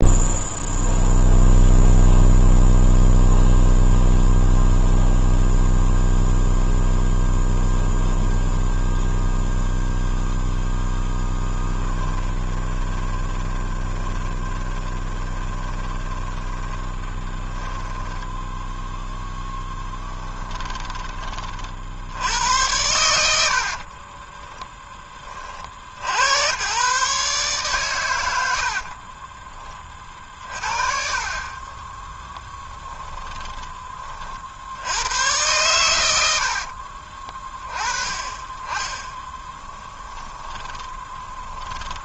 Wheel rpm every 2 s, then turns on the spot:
0, 0, 0, 0, 0, 10, 20, 20, 20, 0, 10, 100, 10, 130, 50, 40, 10, 80, 50, 20, 20.
12-18 20-22 28-34 36-38 40-42